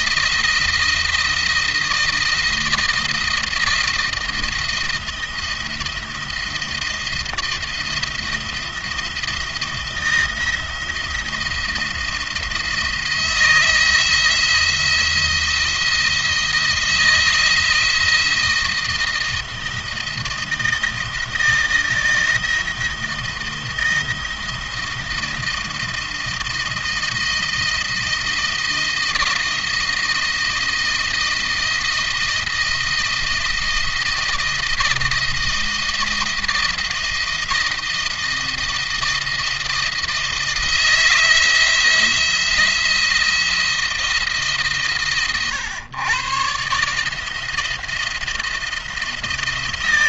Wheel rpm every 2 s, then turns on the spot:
170, 170, 170, 170, 170, 170, 160, 170, 170, 170, 160, 160, 160, 160, 160, 170, 160, 160, 170, 170, 170, 170, 140, 140, 170.
none